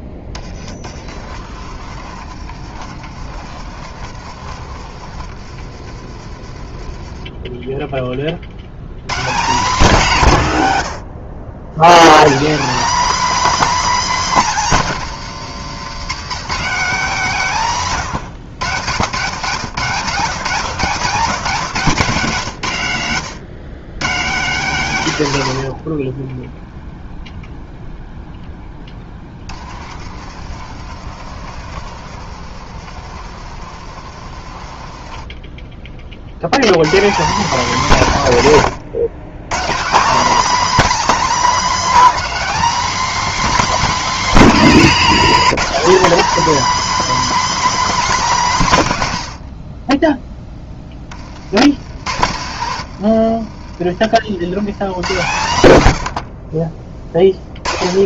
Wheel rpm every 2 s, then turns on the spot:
20, 70, 60, 40, 90, 120, 210, 210, 190, 90, 150, 130, 170, 0, 10, 60, 60, 50, 130, 140, 250, 260, 240, 280, 200, 10, 90, 110, 30.
52-54